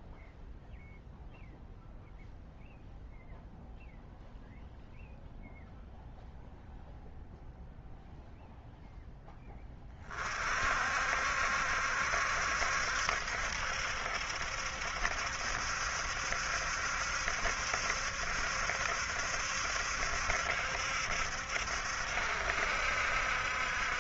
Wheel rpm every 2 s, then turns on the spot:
0, 0, 0, 0, 0, 50, 70, 70, 70, 70, 70, 70.
none